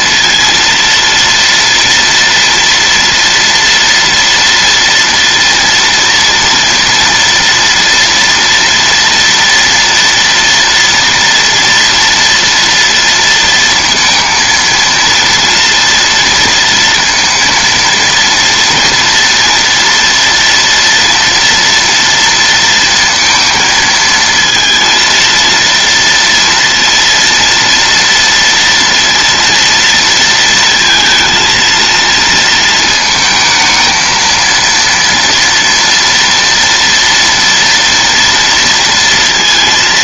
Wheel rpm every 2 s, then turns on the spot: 230, 230, 230, 230, 230, 230, 230, 230, 230, 230, 230, 230, 230, 230, 230, 230, 220, 230, 240, 230.
none